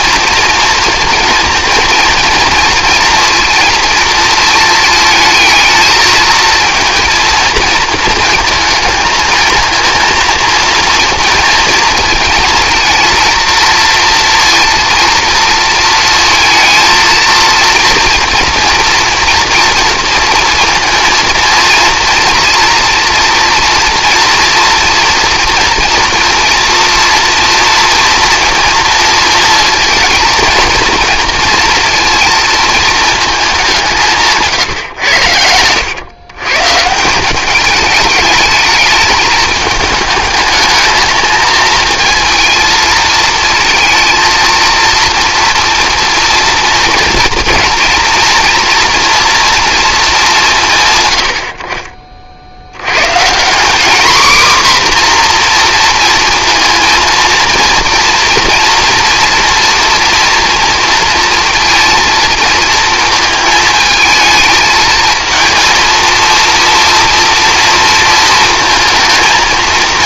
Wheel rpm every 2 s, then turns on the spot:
230, 230, 230, 230, 220, 230, 230, 230, 230, 230, 230, 230, 230, 230, 230, 220, 230, 140, 150, 210, 220, 230, 230, 240, 230, 140, 80, 260, 230, 230, 230, 230, 220, 230, 220.
none